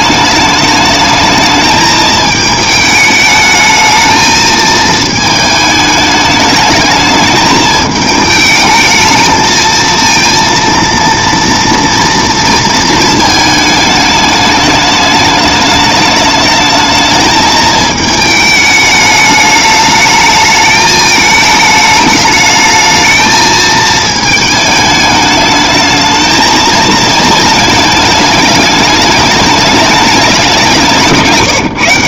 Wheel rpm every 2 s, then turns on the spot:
210, 220, 220, 210, 220, 230, 230, 210, 220, 210, 220, 220, 210, 220, 210, 170.
none